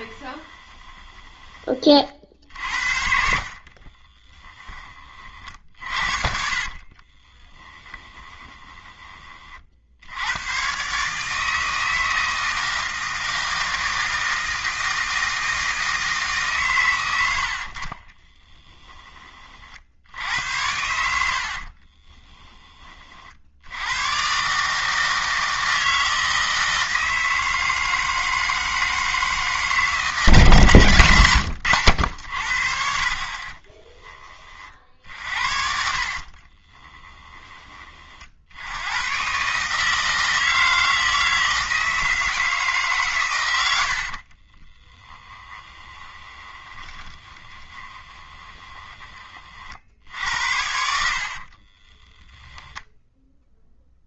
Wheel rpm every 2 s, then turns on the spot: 20, 60, 10, 40, 20, 120, 160, 160, 120, 20, 80, 20, 150, 160, 160, 160, 60, 40, 30, 80, 160, 150, 20, 20, 20, 80, 0.
0-2 6-10 18-20 36-38 44-52